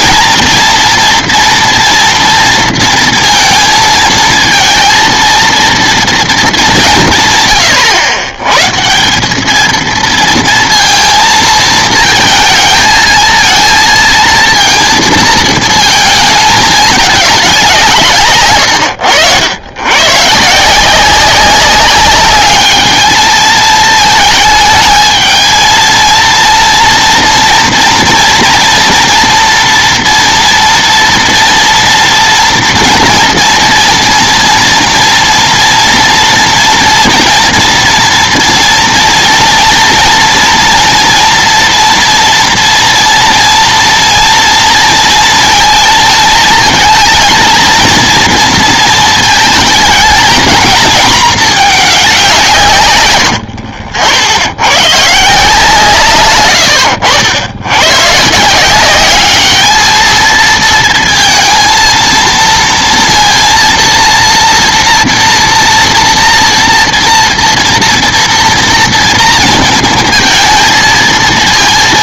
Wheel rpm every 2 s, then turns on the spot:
230, 230, 230, 200, 130, 230, 220, 230, 210, 110, 160, 210, 220, 230, 230, 230, 230, 230, 230, 230, 230, 230, 230, 220, 230, 230, 130, 100, 90, 170, 230, 230, 230, 230, 240, 230.
none